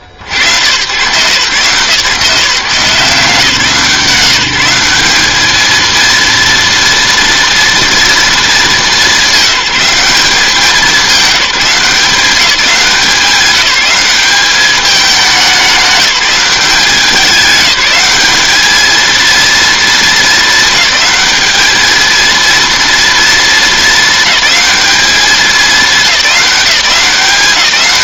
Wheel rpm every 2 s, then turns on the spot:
100, 160, 160, 230, 220, 190, 190, 200, 200, 210, 220, 230, 210, 200.
none